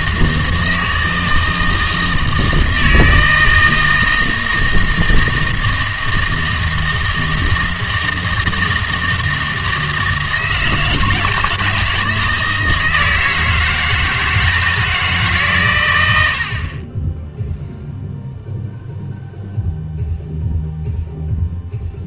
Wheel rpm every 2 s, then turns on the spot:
160, 160, 160, 160, 160, 160, 160, 160, 50, 0, 0.
none